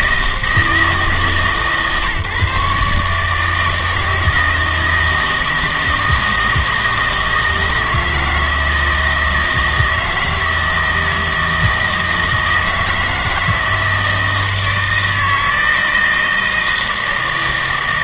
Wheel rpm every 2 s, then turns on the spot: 150, 140, 160, 160, 160, 160, 160, 160, 160.
none